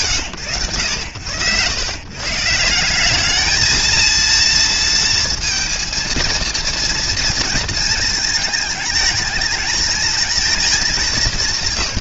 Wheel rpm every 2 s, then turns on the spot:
90, 150, 230, 230, 220, 210.
none